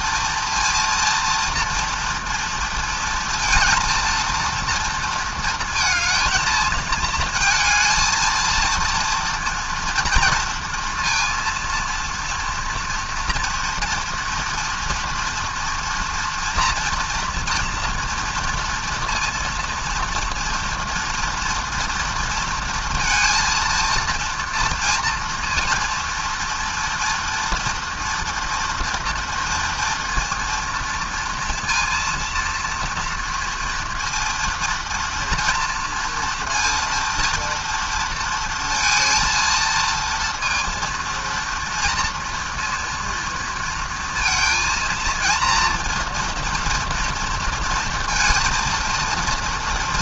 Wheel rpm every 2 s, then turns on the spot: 230, 230, 230, 220, 230, 230, 240, 230, 230, 230, 240, 230, 230, 230, 230, 230, 230, 230, 230, 230, 230, 230, 230, 230, 230.
none